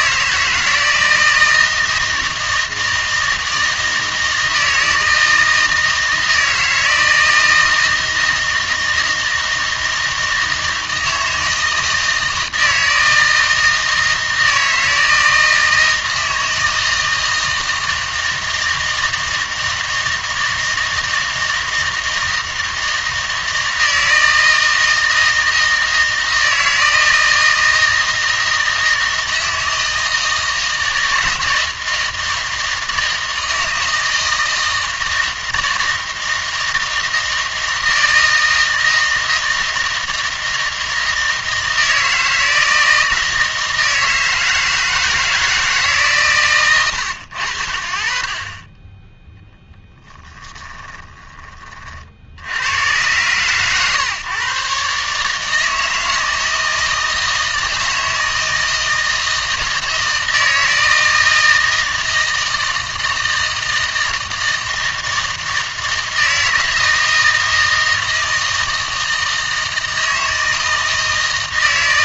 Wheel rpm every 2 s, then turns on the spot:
160, 160, 160, 160, 160, 160, 160, 160, 160, 160, 160, 160, 160, 160, 160, 160, 160, 160, 160, 160, 160, 160, 160, 110, 20, 20, 100, 140, 160, 160, 160, 160, 160, 160, 160, 160.
50-52